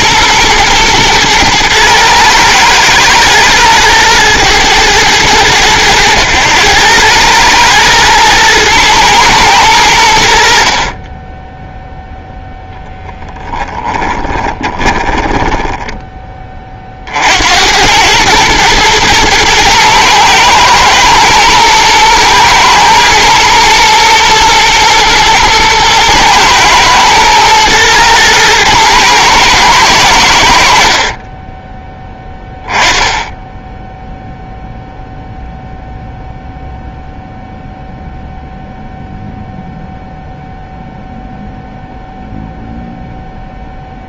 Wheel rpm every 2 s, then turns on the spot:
120, 110, 110, 100, 110, 40, 10, 20, 40, 110, 110, 120, 110, 110, 110, 60, 10, 0, 0, 0, 0, 0.
14-16 30-32